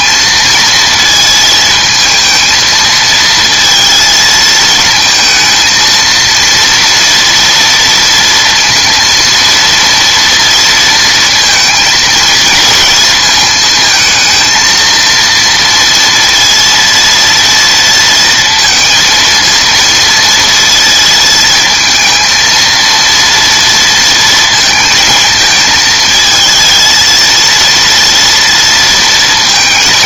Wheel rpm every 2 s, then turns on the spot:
230, 220, 230, 230, 230, 230, 220, 220, 230, 220, 230, 230, 230, 220, 230.
none